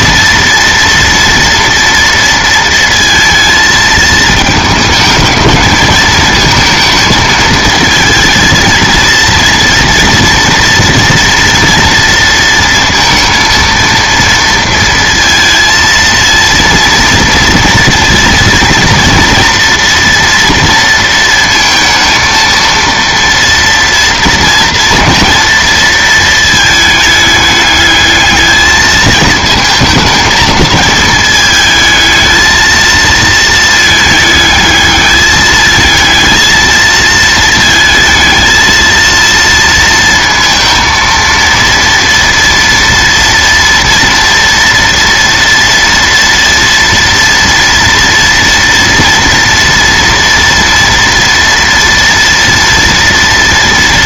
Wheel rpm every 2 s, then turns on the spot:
230, 230, 220, 220, 230, 230, 230, 230, 230, 230, 230, 230, 230, 220, 220, 220, 220, 220, 220, 220, 230, 230, 230, 230, 230, 230, 230.
none